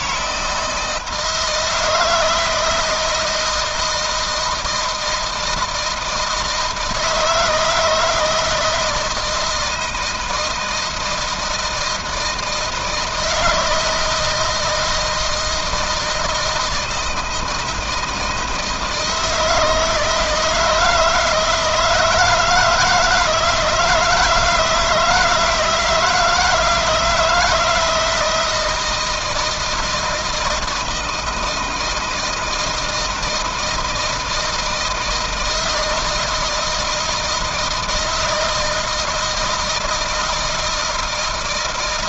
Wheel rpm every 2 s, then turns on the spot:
160, 160, 160, 160, 160, 160, 160, 160, 160, 160, 160, 160, 160, 170, 170, 160, 160, 160, 160, 160, 160.
none